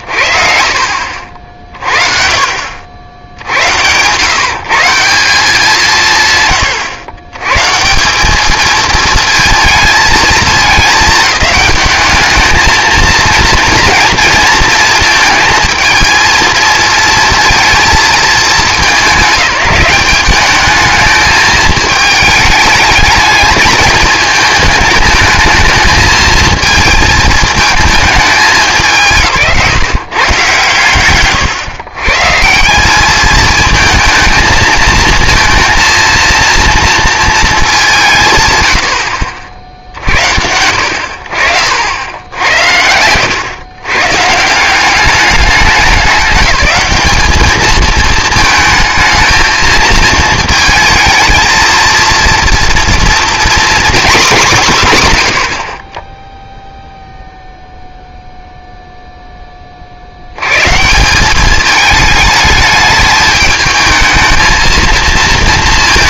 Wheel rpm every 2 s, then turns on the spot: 40, 60, 160, 110, 220, 220, 220, 230, 230, 210, 210, 210, 220, 220, 210, 130, 170, 220, 230, 90, 70, 80, 170, 200, 220, 230, 230, 180, 0, 0, 130, 210, 220.
none